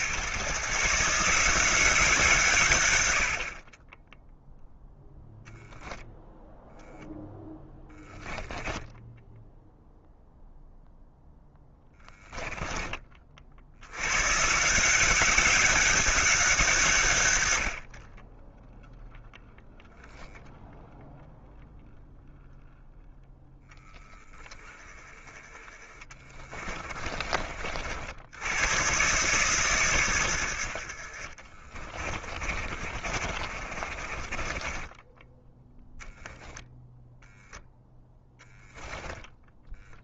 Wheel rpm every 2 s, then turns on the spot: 140, 120, 0, 0, 10, 0, 20, 160, 150, 0, 0, 0, 10, 30, 120, 70, 30, 20, 0, 10.
26-28 32-36 38-40